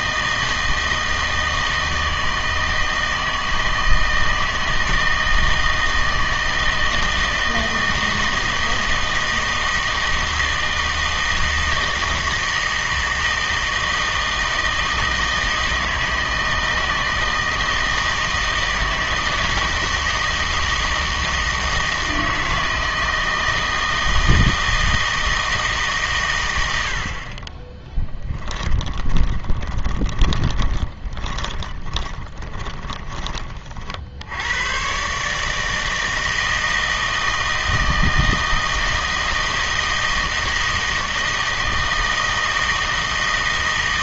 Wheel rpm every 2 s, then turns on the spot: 160, 160, 160, 160, 160, 160, 160, 160, 160, 160, 160, 160, 160, 90, 20, 20, 20, 110, 160, 160, 160, 160.
28-34